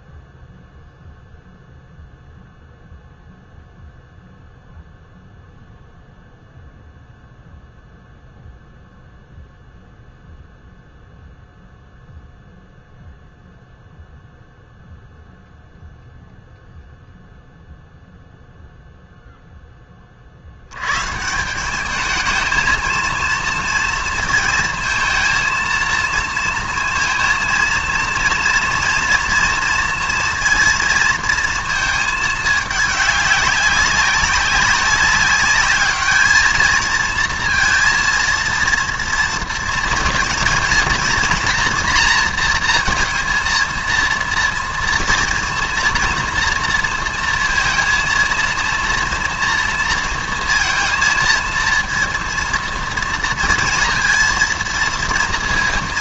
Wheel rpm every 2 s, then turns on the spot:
0, 0, 0, 0, 0, 0, 0, 0, 0, 0, 60, 220, 230, 230, 230, 230, 210, 190, 220, 230, 230, 230, 230, 230, 230, 230, 230, 230.
none